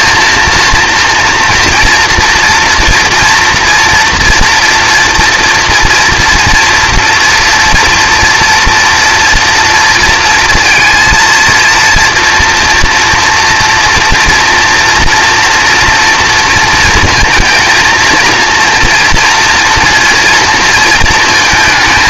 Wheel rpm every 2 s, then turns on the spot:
230, 240, 230, 240, 230, 230, 230, 230, 230, 230, 230.
none